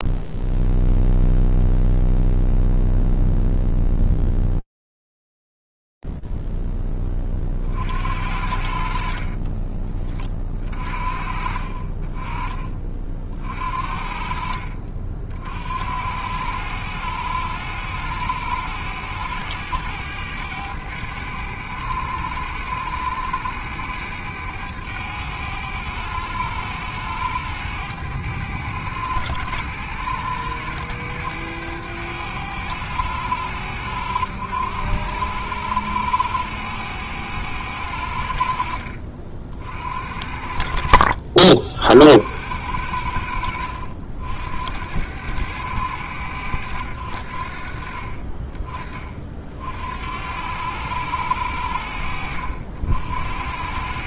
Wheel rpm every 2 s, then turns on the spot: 0, 0, 0, 0, 50, 30, 40, 50, 70, 100, 100, 100, 100, 100, 100, 100, 100, 100, 100, 60, 60, 80, 80, 90, 30, 90, 70.
10-12